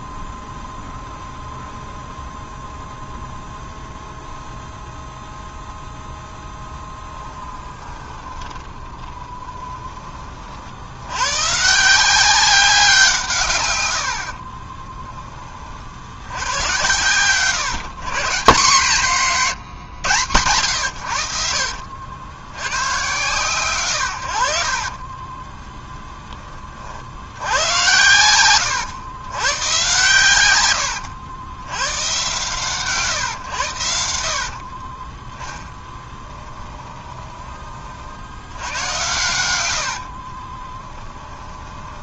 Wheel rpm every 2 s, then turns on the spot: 0, 0, 0, 10, 20, 70, 180, 20, 110, 150, 90, 110, 40, 50, 100, 90, 120, 30, 20, 90, 10.
6-10 14-16 34-38 40-42